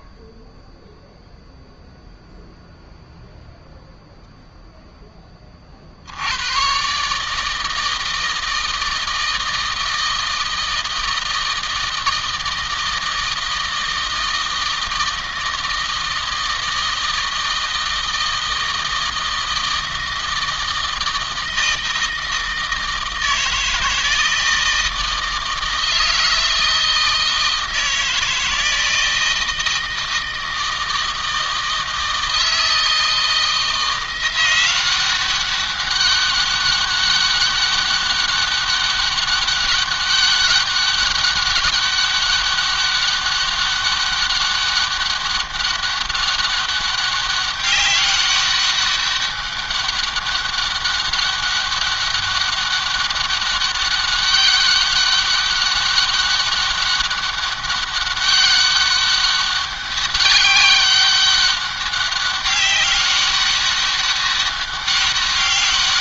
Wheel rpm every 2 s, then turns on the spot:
0, 0, 0, 110, 160, 160, 160, 160, 160, 160, 160, 160, 160, 160, 160, 160, 160, 180, 200, 200, 200, 200, 200, 200, 200, 200, 200, 200, 200, 200, 200, 200, 200.
none